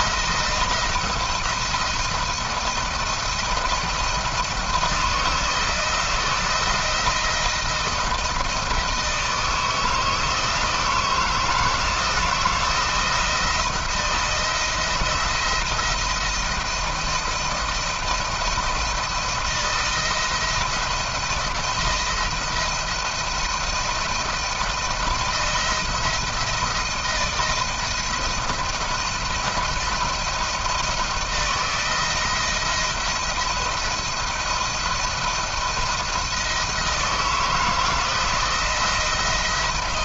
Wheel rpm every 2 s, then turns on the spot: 170, 170, 170, 170, 160, 160, 170, 170, 170, 160, 170, 160, 160, 160, 160, 170, 170, 160, 160, 160.
none